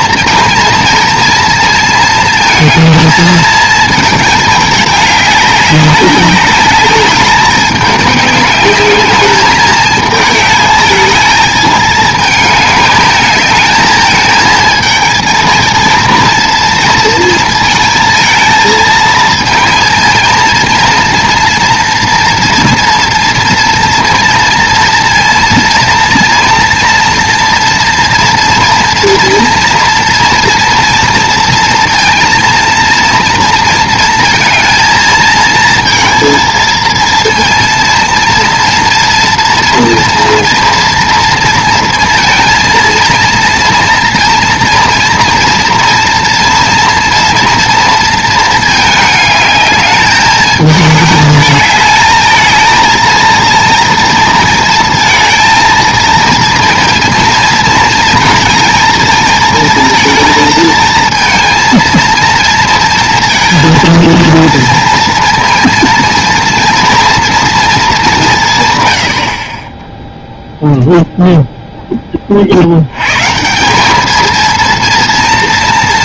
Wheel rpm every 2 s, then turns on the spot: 230, 220, 200, 200, 210, 220, 210, 220, 230, 220, 230, 230, 230, 230, 240, 230, 230, 220, 230, 230, 230, 230, 230, 230, 220, 210, 230, 230, 230, 220, 220, 230, 230, 230, 90, 0, 100, 230.
none